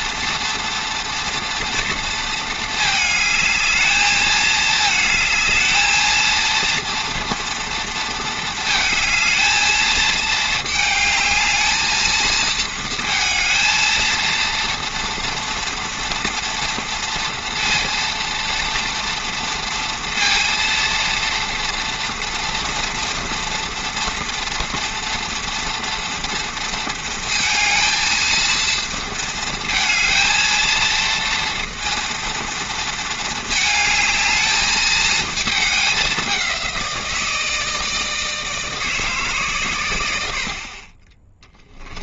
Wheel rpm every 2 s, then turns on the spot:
230, 220, 220, 230, 230, 220, 230, 230, 240, 230, 230, 230, 240, 230, 230, 230, 230, 220, 190, 160, 80.
none